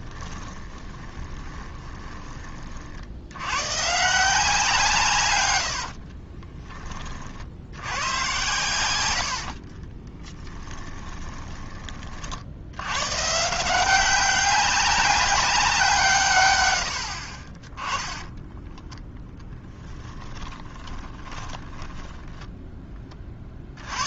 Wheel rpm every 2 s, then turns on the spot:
20, 50, 160, 20, 90, 10, 100, 190, 100, 20, 30, 10.
0-2 8-12 18-22